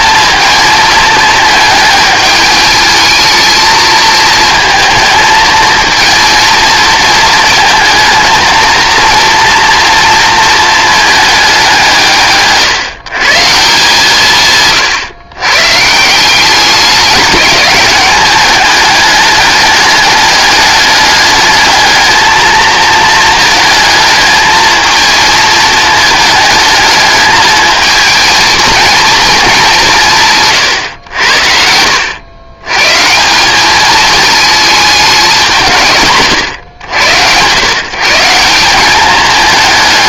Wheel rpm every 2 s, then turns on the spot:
220, 210, 220, 230, 230, 220, 140, 130, 200, 210, 210, 220, 220, 220, 230, 120, 120, 210, 90, 190.
none